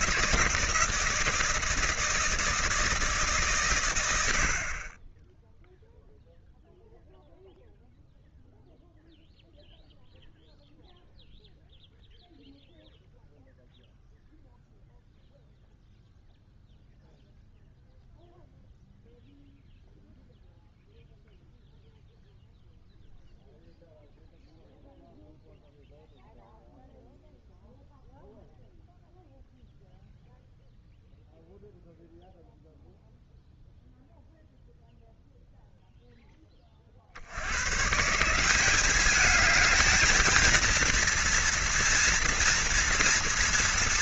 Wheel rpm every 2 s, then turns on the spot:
160, 150, 10, 0, 0, 0, 0, 0, 0, 0, 0, 0, 0, 0, 0, 0, 0, 0, 60, 210, 230, 230.
none